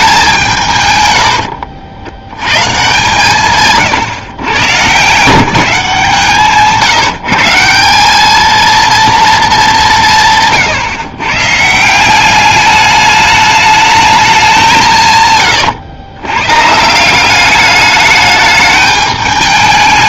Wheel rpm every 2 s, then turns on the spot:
140, 140, 130, 150, 230, 150, 200, 180, 140, 210.
none